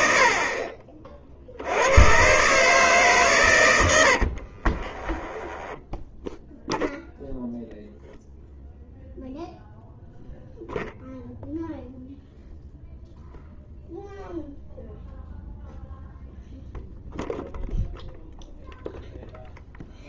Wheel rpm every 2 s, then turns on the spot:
60, 120, 10, 0, 0, 0, 0, 0, 0, 0.
4-6